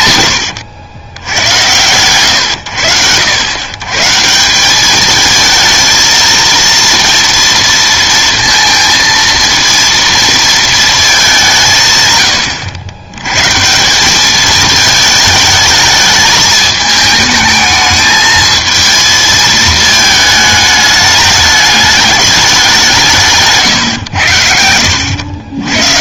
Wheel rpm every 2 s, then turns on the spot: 80, 110, 190, 230, 230, 220, 100, 210, 210, 220, 220, 200, 90.
none